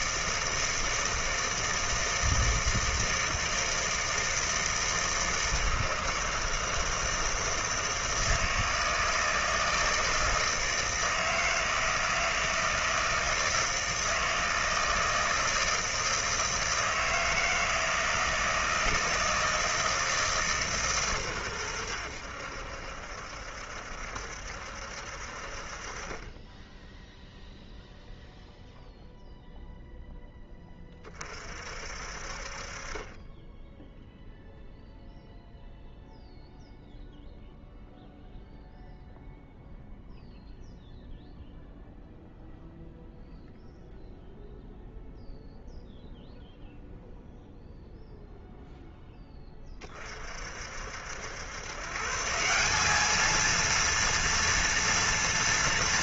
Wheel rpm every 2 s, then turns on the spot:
160, 160, 160, 160, 160, 160, 160, 160, 160, 160, 150, 80, 70, 10, 0, 10, 40, 0, 0, 0, 0, 0, 0, 0, 0, 50, 170, 230.
none